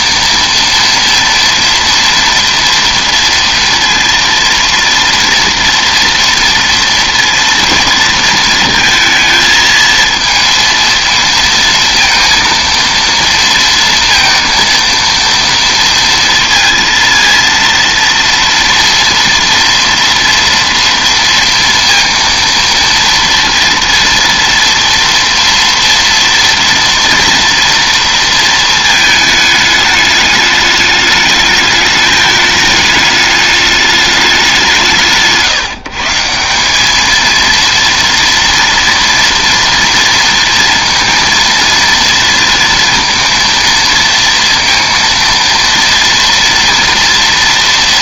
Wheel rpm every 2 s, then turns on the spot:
230, 230, 230, 230, 230, 230, 230, 230, 230, 230, 230, 230, 230, 240, 220, 210, 210, 160, 200, 230, 230, 230, 230, 230.
none